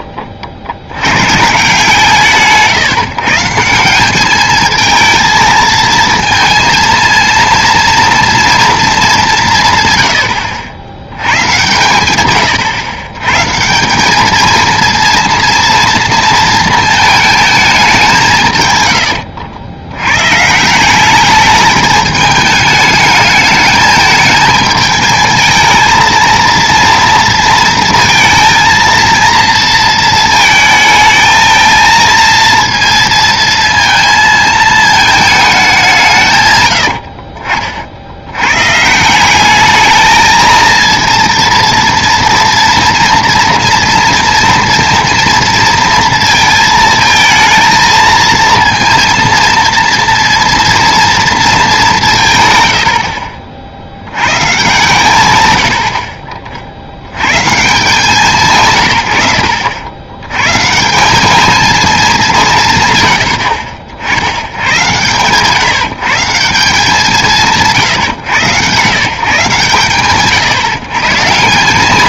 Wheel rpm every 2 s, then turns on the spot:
60, 150, 220, 230, 230, 80, 120, 220, 230, 140, 160, 210, 220, 230, 230, 220, 230, 220, 120, 130, 230, 230, 230, 230, 230, 230, 100, 130, 50, 130, 150, 140, 110, 180, 120, 140.
52-54